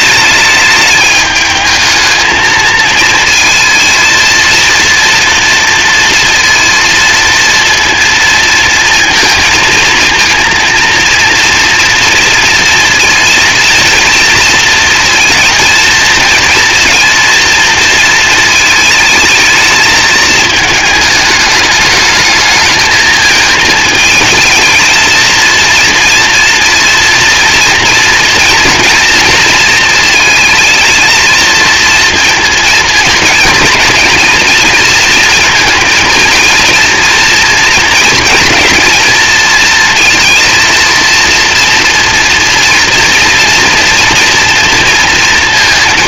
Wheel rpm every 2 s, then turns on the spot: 210, 220, 230, 230, 230, 230, 230, 230, 230, 220, 220, 220, 220, 230, 230, 220, 220, 230, 230, 220, 230, 240, 230.
none